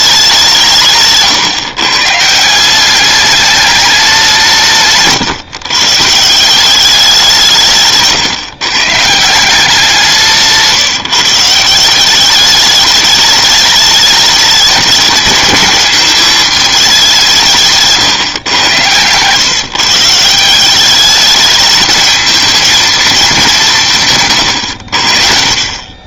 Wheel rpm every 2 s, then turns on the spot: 160, 190, 150, 190, 150, 160, 210, 210, 210, 120, 190, 230, 80.
none